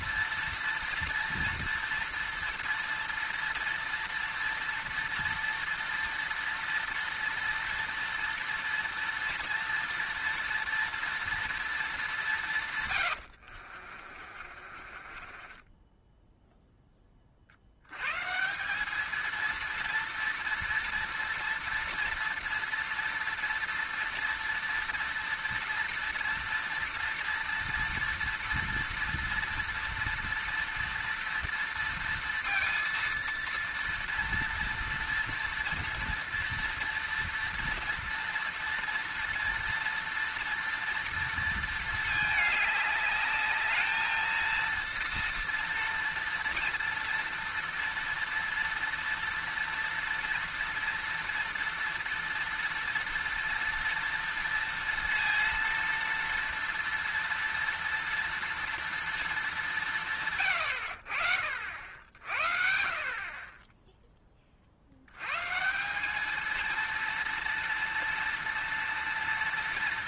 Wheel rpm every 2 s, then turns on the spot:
230, 230, 230, 230, 230, 230, 160, 40, 0, 170, 230, 230, 230, 230, 230, 230, 230, 230, 230, 230, 230, 210, 230, 230, 230, 230, 230, 230, 230, 230, 120, 50, 40, 220, 230.
14-16